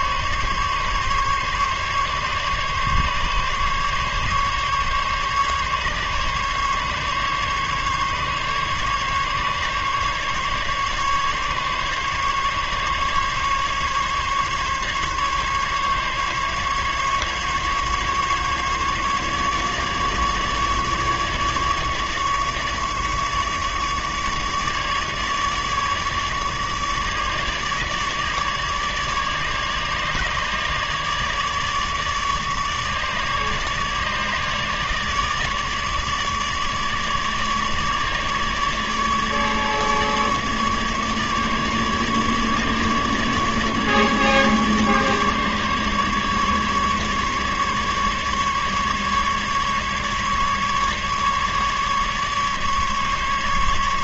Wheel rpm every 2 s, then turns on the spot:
140, 140, 140, 140, 140, 140, 140, 140, 140, 150, 150, 150, 150, 150, 150, 150, 150, 150, 150, 150, 150, 150, 150, 150, 150, 140, 150.
none